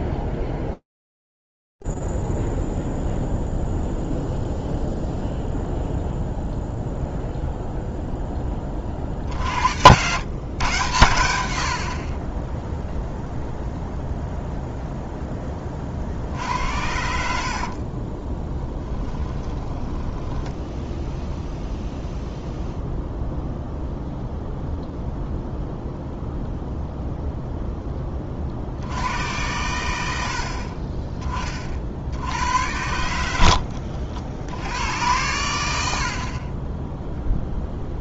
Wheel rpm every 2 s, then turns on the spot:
0, 0, 0, 0, 20, 130, 20, 0, 60, 10, 10, 0, 0, 0, 80, 40, 90, 80, 20.
18-22